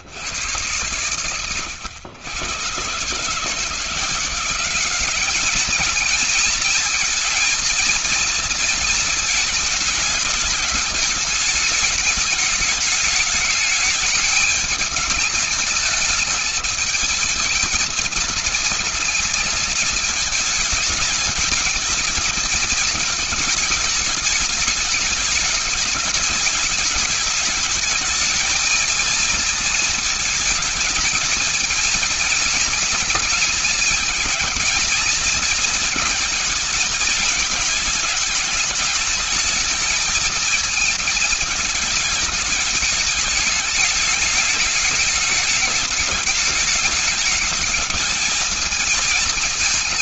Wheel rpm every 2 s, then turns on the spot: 110, 140, 200, 220, 220, 220, 210, 210, 220, 230, 220, 220, 210, 210, 220, 220, 230, 220, 220, 220, 220, 220, 210, 210, 220.
none